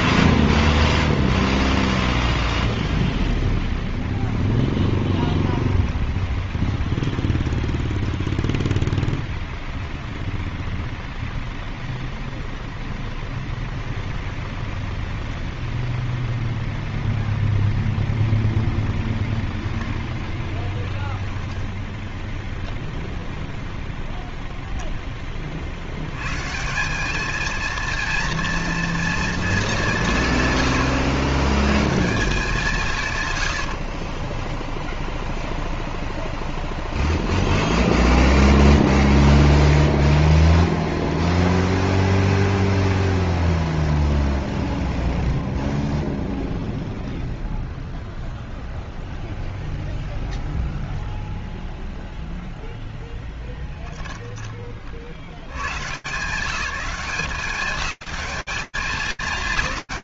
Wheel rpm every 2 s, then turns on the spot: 10, 0, 0, 0, 0, 0, 0, 0, 0, 10, 10, 0, 40, 230, 210, 130, 90, 0, 0, 0, 0, 0, 0, 0, 0, 0, 10, 120, 200, 210.
none